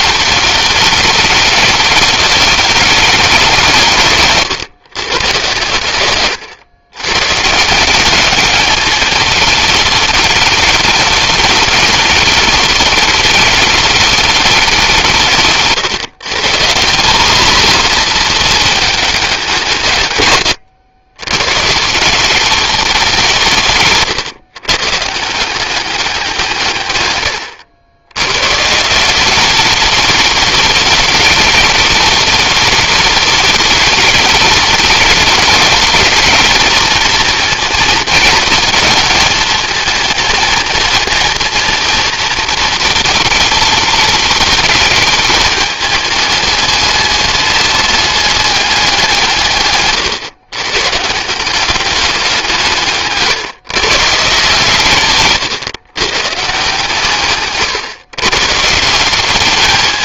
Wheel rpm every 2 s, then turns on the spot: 210, 170, 110, 160, 210, 210, 210, 140, 220, 170, 140, 140, 190, 100, 210, 210, 220, 210, 220, 220, 230, 220, 210, 210, 140, 190, 140, 140, 140, 210.
none